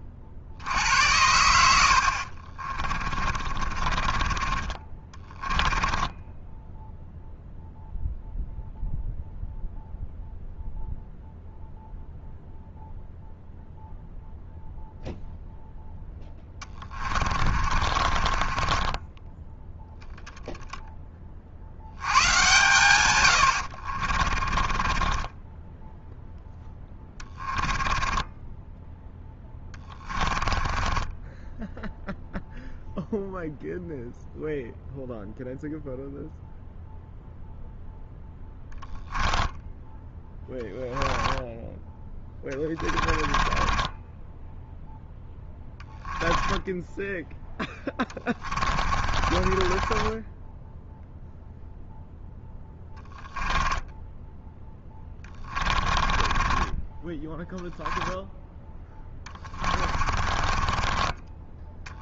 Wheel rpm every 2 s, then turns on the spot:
90, 20, 20, 0, 0, 0, 0, 0, 40, 10, 40, 100, 20, 10, 10, 20, 0, 0, 0, 20, 10, 30, 0, 10, 30, 0, 10, 20, 10, 20, 20.
2-6 16-20 24-32 38-40 42-44 48-50 52-60